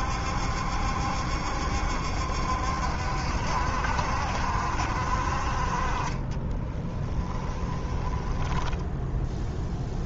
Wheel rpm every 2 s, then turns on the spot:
70, 70, 50, 20, 10.
6-10